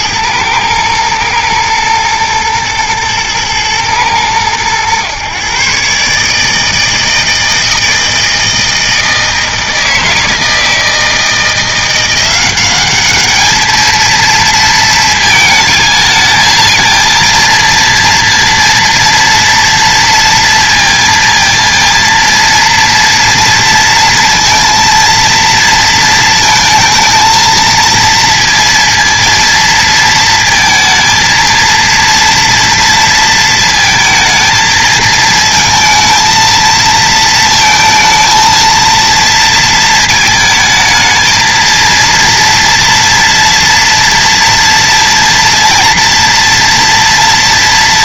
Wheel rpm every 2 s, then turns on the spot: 110, 110, 110, 160, 160, 160, 190, 220, 230, 230, 230, 230, 230, 220, 230, 230, 230, 220, 220, 230, 220, 230, 230, 240.
none